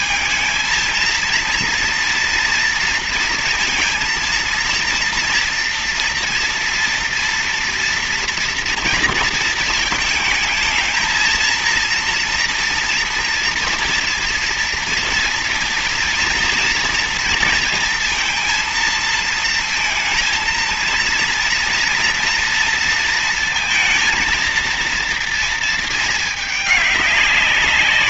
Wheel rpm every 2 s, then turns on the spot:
220, 230, 230, 230, 230, 220, 230, 230, 230, 230, 230, 230, 230, 210.
none